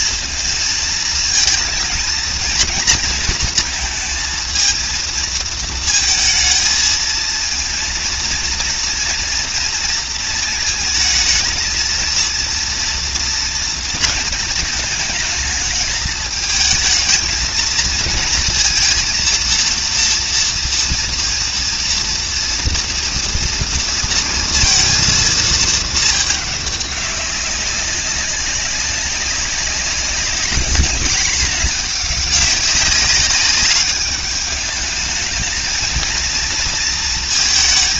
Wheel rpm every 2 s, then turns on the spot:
220, 230, 230, 230, 240, 220, 230, 220, 220, 230, 230, 230, 230, 200, 190, 210, 200, 210, 230.
none